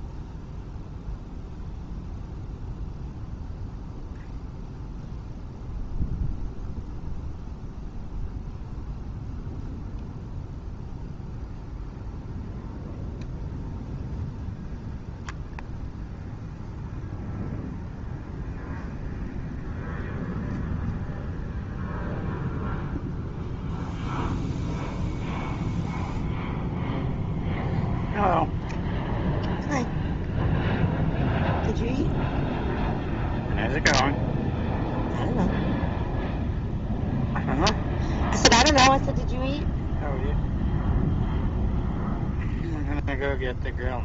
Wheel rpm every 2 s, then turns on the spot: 0, 0, 0, 0, 0, 0, 0, 0, 0, 0, 0, 0, 0, 0, 0, 0, 0, 0, 0, 0, 0, 0.
none